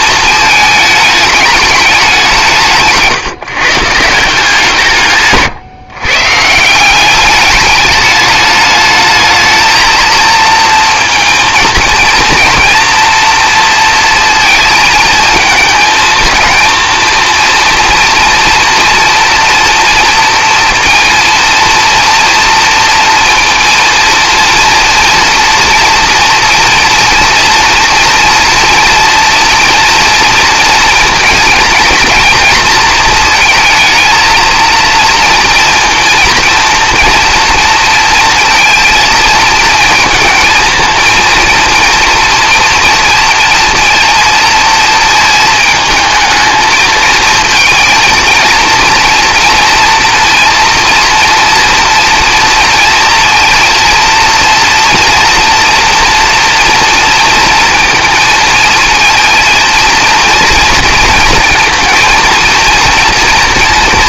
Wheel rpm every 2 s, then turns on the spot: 220, 160, 160, 170, 210, 230, 240, 220, 230, 230, 230, 230, 230, 230, 230, 230, 230, 230, 230, 230, 230, 230, 220, 220, 230, 230, 230, 230, 230, 230, 230, 230.
2-4